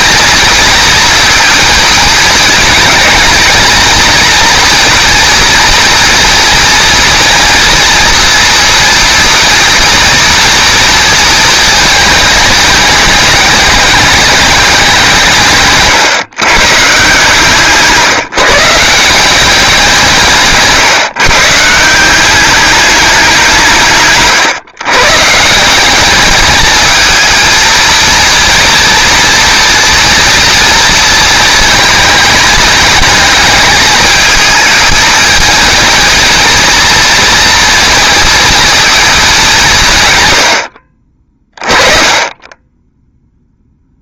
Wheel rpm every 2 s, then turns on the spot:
230, 230, 230, 230, 230, 230, 210, 190, 140, 160, 150, 200, 140, 220, 230, 230, 220, 210, 230, 220, 60, 10.
none